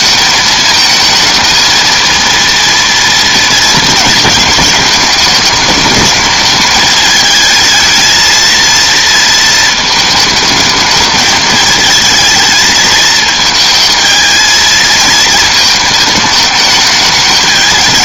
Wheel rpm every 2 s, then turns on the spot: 220, 230, 220, 220, 230, 220, 220, 220, 210.
none